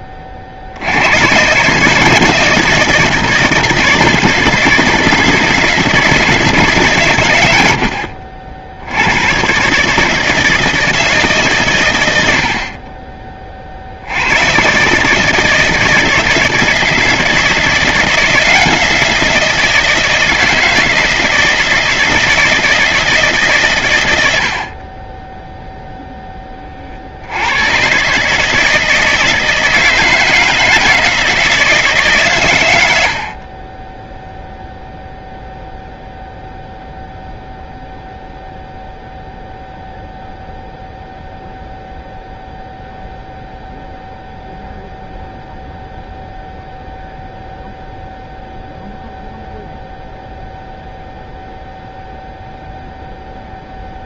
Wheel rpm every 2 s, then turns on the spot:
80, 160, 160, 120, 90, 160, 40, 140, 160, 170, 160, 160, 40, 50, 160, 160, 90, 0, 0, 0, 0, 0, 0, 0, 0, 0, 0.
none